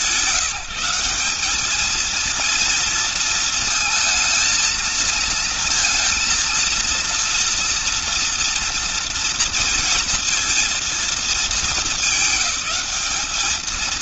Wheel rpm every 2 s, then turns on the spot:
190, 230, 230, 230, 230, 220, 200.
none